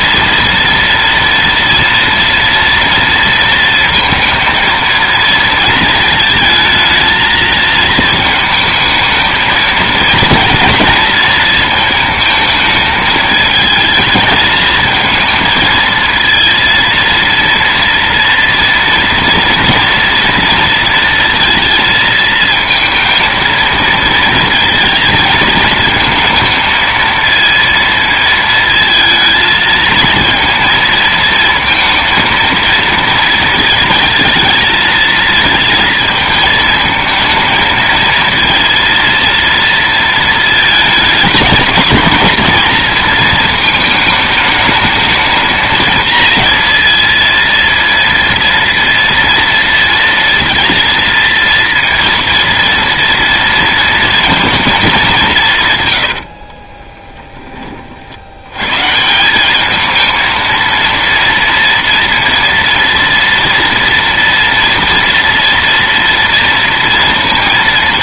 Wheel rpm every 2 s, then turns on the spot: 230, 230, 230, 220, 220, 230, 220, 220, 230, 230, 230, 220, 230, 230, 220, 220, 230, 230, 220, 230, 230, 230, 220, 230, 230, 230, 230, 230, 40, 100, 230, 230, 230, 230.
56-58